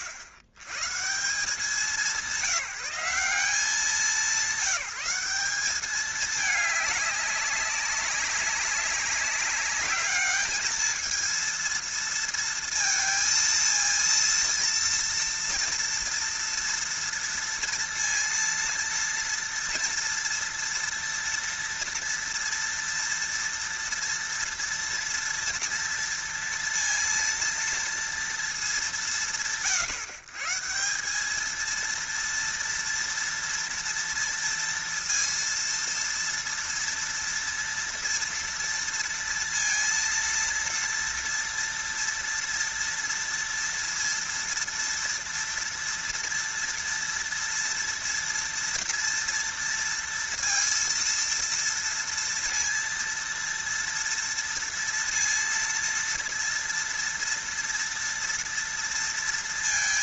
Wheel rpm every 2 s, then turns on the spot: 60, 170, 180, 210, 200, 220, 230, 230, 230, 230, 230, 230, 230, 230, 120, 170, 230, 230, 230, 230, 230, 230, 230, 230, 230, 230, 230, 230, 230, 230.
none